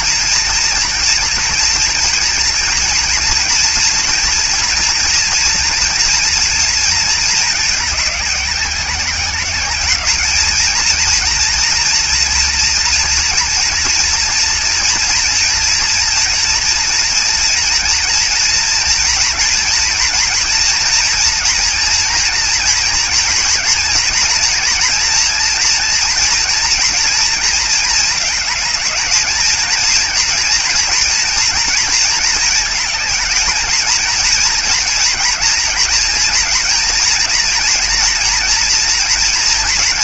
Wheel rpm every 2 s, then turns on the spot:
240, 240, 230, 220, 200, 220, 230, 230, 230, 230, 230, 240, 240, 230, 220, 230, 220, 230, 230, 230.
none